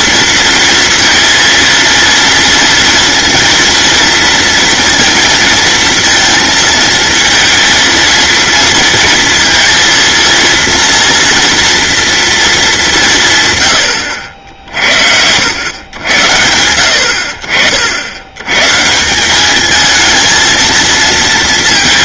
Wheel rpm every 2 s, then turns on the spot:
230, 230, 230, 230, 230, 230, 220, 60, 80, 130, 230.
none